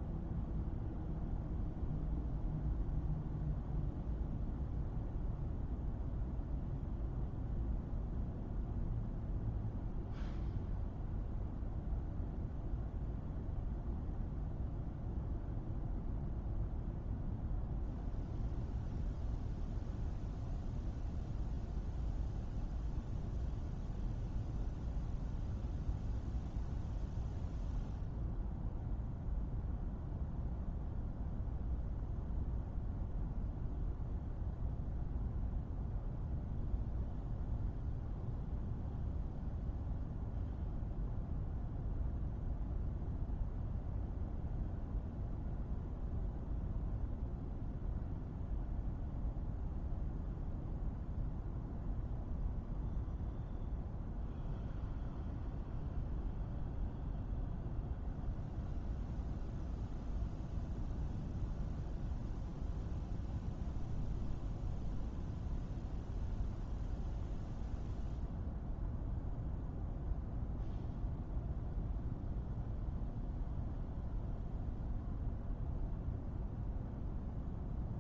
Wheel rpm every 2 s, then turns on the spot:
0, 0, 0, 0, 0, 0, 0, 0, 0, 0, 0, 0, 0, 0, 0, 0, 0, 0, 0, 0, 0, 0, 0, 0, 0, 0, 0, 0, 0, 0, 0, 0, 0, 0, 0, 0, 0, 0, 0.
none